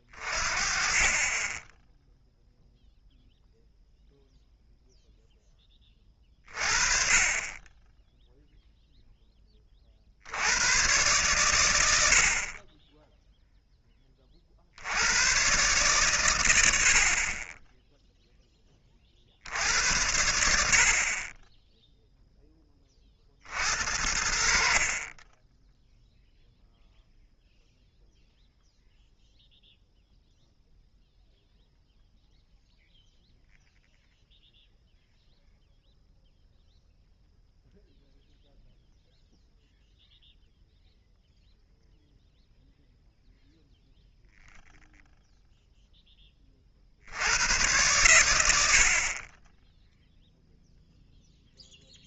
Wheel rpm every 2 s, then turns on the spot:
30, 0, 0, 50, 0, 120, 10, 100, 70, 30, 50, 20, 50, 0, 0, 0, 0, 0, 0, 0, 0, 0, 0, 20, 80, 0.
none